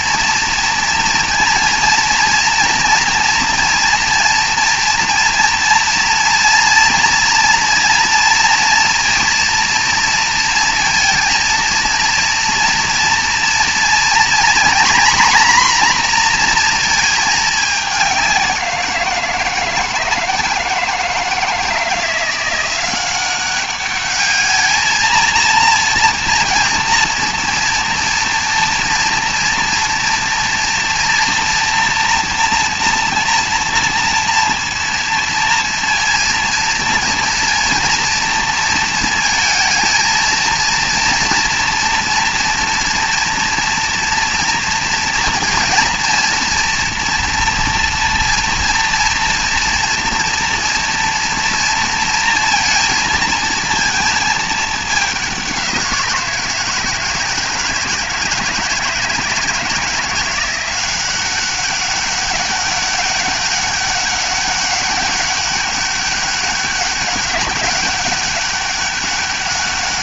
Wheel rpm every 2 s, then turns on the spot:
230, 230, 230, 230, 230, 230, 230, 240, 240, 180, 160, 180, 220, 230, 230, 230, 240, 240, 230, 230, 230, 230, 230, 230, 230, 230, 230, 210, 170, 170, 180, 200, 200, 200, 200.
none